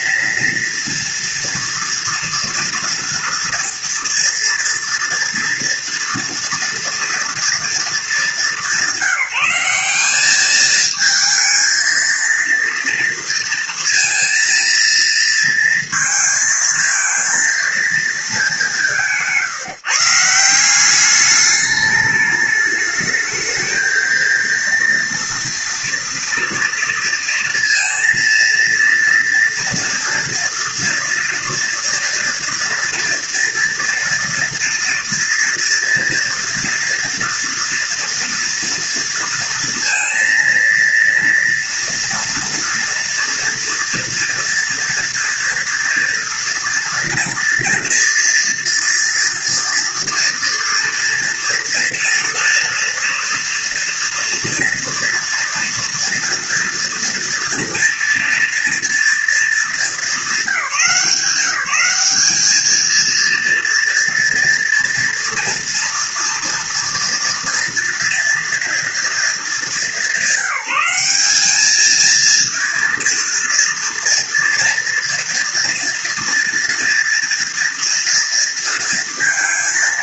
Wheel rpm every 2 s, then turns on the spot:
230, 230, 240, 230, 190, 220, 230, 230, 220, 150, 210, 220, 230, 230, 230, 240, 230, 240, 230, 230, 230, 230, 240, 230, 240, 230, 230, 230, 230, 230, 190, 230, 230, 240, 220, 200, 230, 230, 230, 230.
none